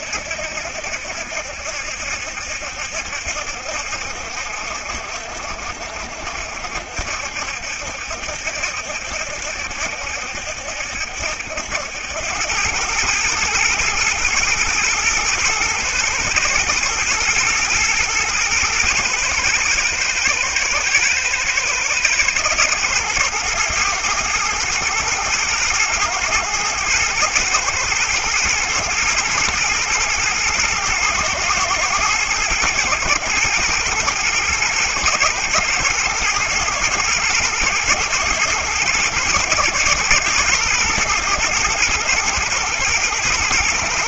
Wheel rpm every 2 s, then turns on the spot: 70, 70, 70, 60, 70, 70, 100, 110, 110, 120, 120, 110, 110, 110, 120, 120, 110, 110, 120, 110, 120, 120.
none